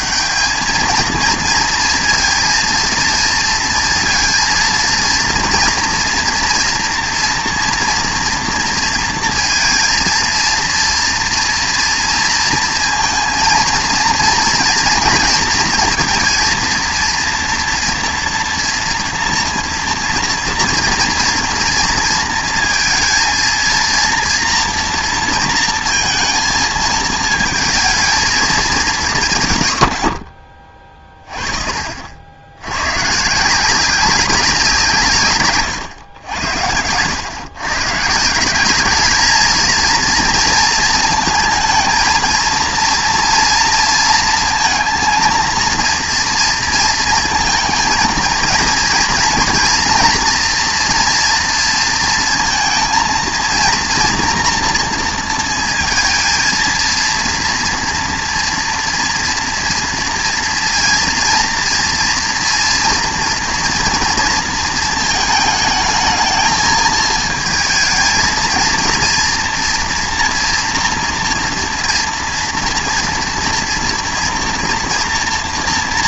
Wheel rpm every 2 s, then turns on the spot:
210, 230, 230, 230, 230, 230, 230, 230, 230, 230, 230, 230, 240, 220, 210, 40, 110, 170, 90, 200, 230, 230, 230, 230, 230, 240, 230, 230, 230, 230, 230, 230, 230, 220, 230, 240, 230, 230.
none